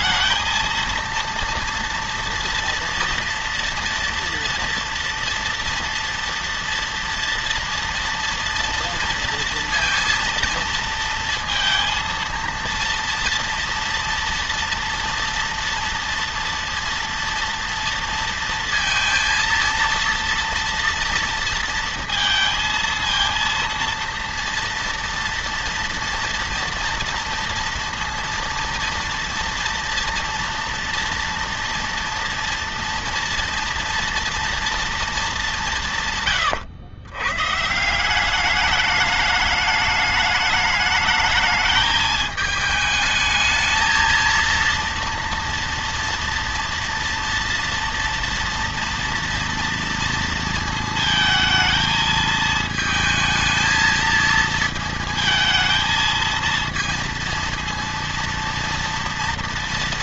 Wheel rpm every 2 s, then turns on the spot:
220, 230, 230, 230, 230, 230, 230, 230, 230, 230, 230, 230, 230, 230, 230, 230, 230, 230, 170, 180, 210, 220, 220, 230, 240, 230, 220, 220, 220, 230.
none